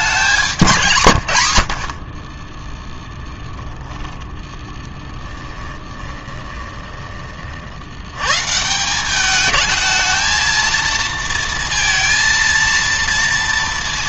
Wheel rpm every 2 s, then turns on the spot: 170, 10, 20, 20, 160, 230, 230.
0-2 4-8